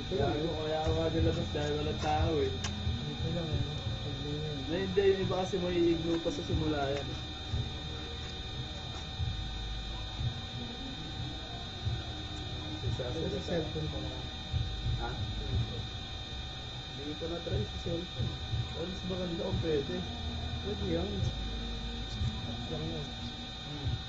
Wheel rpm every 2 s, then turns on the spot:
0, 0, 0, 0, 0, 0, 0, 0, 0, 0, 0, 0.
none